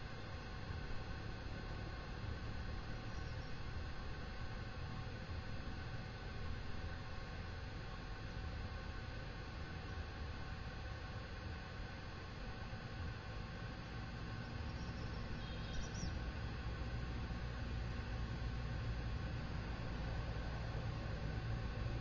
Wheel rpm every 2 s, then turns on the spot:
0, 0, 0, 0, 0, 0, 0, 0, 0, 0, 0.
none